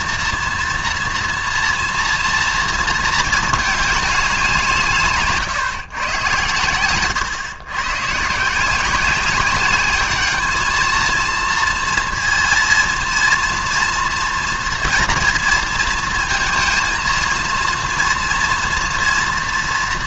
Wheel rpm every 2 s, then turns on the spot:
230, 230, 170, 110, 180, 220, 230, 230, 230, 230.
none